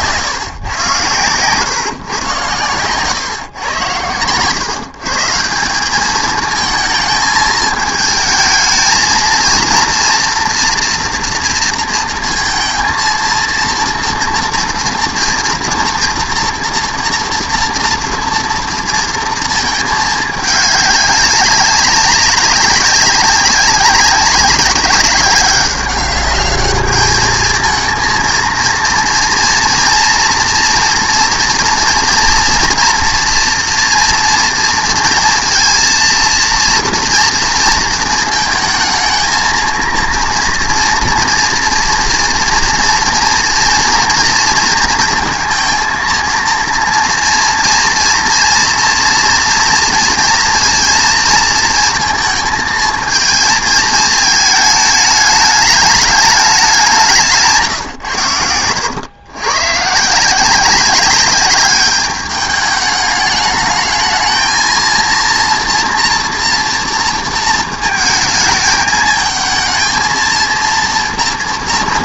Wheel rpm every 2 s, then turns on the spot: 120, 110, 140, 220, 220, 240, 230, 230, 240, 230, 210, 190, 200, 210, 230, 240, 240, 230, 230, 220, 230, 240, 230, 230, 230, 230, 220, 220, 200, 90, 190, 210, 230, 230, 220, 230.
none